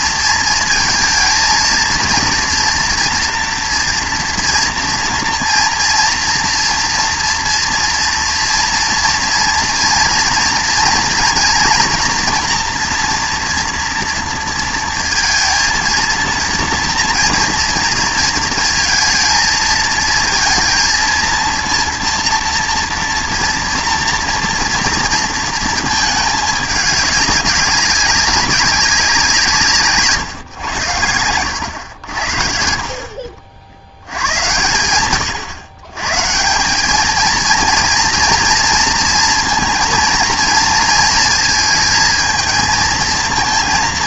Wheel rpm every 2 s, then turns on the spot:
230, 230, 230, 240, 230, 240, 240, 230, 240, 230, 230, 230, 230, 200, 190, 100, 60, 110, 190, 230, 230, 220.
none